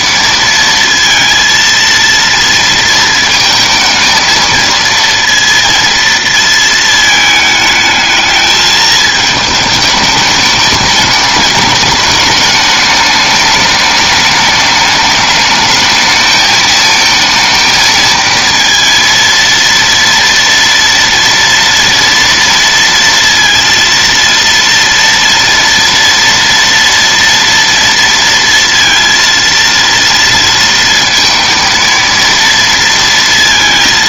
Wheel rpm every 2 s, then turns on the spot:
230, 230, 230, 220, 220, 210, 210, 210, 220, 230, 230, 230, 230, 230, 230, 230, 230.
none